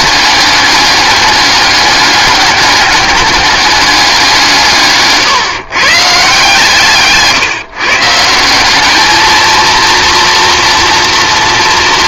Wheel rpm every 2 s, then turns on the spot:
200, 200, 160, 160, 200, 240.
none